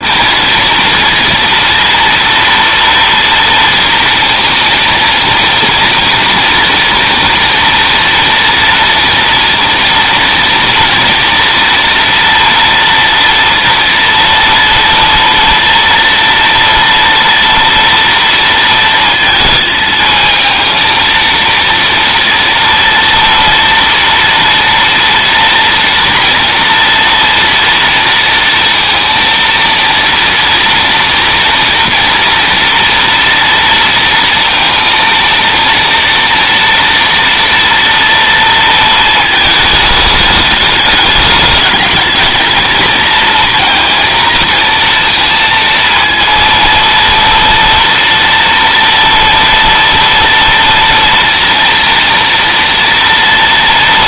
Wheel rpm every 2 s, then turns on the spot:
230, 230, 230, 230, 230, 230, 230, 230, 230, 230, 220, 230, 230, 240, 230, 230, 230, 230, 230, 230, 210, 220, 230, 230, 230, 230, 240.
none